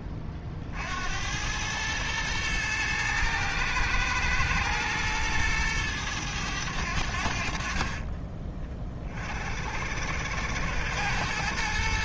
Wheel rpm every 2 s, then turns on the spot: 60, 110, 110, 100, 30, 100.
none